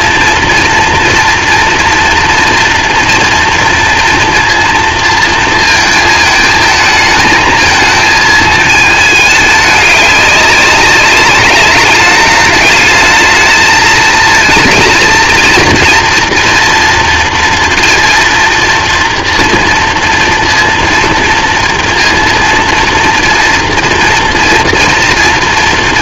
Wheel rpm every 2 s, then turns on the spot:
230, 240, 230, 220, 210, 200, 210, 230, 230, 230, 230, 230, 220.
none